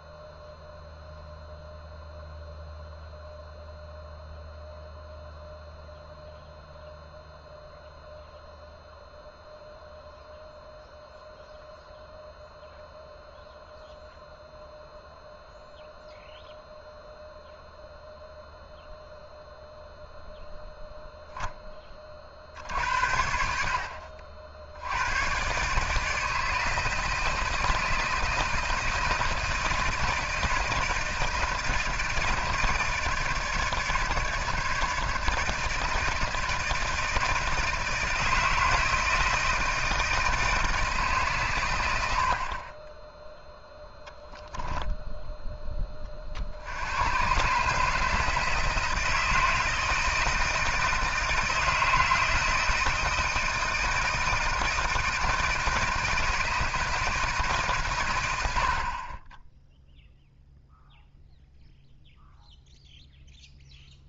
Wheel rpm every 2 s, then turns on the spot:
0, 0, 0, 0, 0, 0, 0, 0, 0, 0, 0, 70, 80, 160, 160, 160, 160, 150, 160, 160, 150, 20, 10, 80, 160, 160, 160, 160, 160, 60, 0, 0.
44-46